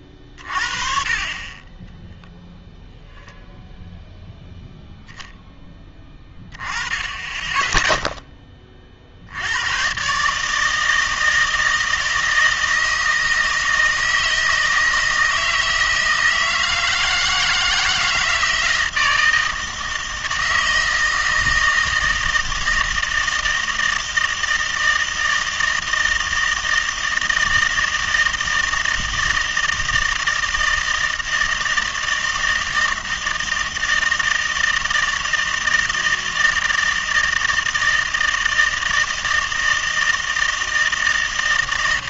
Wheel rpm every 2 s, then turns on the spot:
40, 0, 0, 20, 40, 160, 160, 160, 160, 160, 160, 160, 160, 160, 160, 160, 160, 160, 160, 160, 160.
none